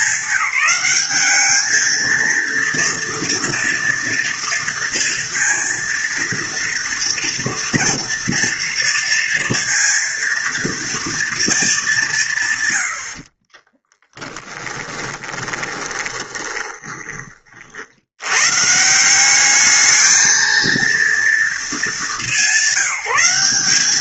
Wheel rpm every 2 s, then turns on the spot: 200, 230, 230, 230, 230, 230, 140, 10, 20, 110, 220, 200.
14-18